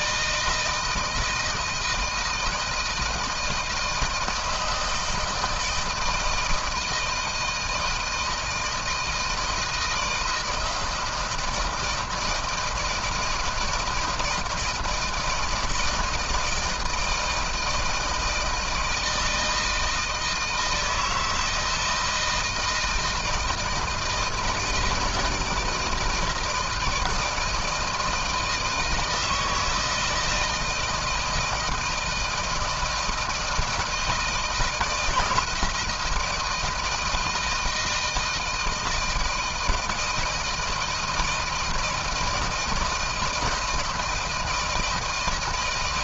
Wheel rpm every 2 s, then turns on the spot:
160, 160, 160, 160, 160, 160, 160, 160, 160, 160, 160, 170, 160, 160, 160, 160, 170, 160, 160, 160, 160, 160, 160.
none